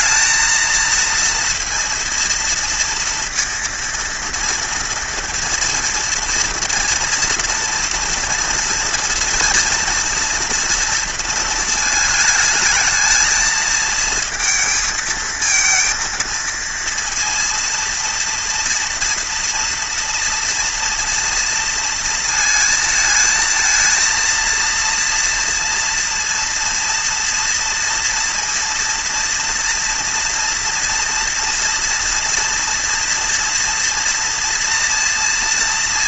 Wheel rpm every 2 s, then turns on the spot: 220, 230, 230, 230, 230, 230, 220, 220, 230, 230, 230, 230, 230, 230, 230, 230, 230, 230.
none